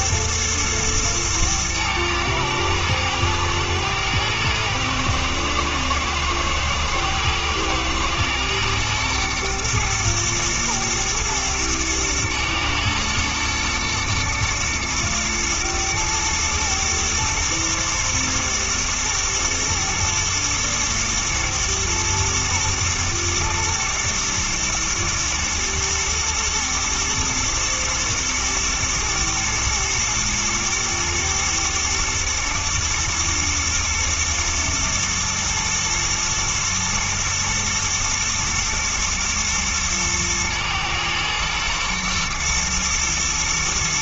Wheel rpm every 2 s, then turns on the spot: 120, 110, 110, 120, 120, 120, 120, 120, 110, 110, 120, 110, 110, 120, 110, 110, 110, 120, 110, 110, 110, 110.
none